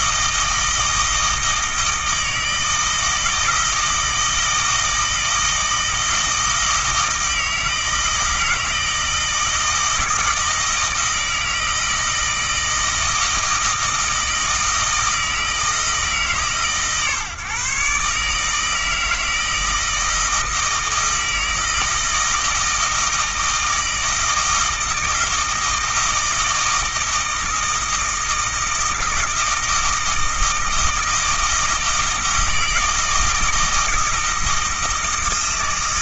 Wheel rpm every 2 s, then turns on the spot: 160, 160, 160, 160, 160, 160, 160, 160, 150, 160, 160, 160, 160, 160, 160, 160, 160, 160.
none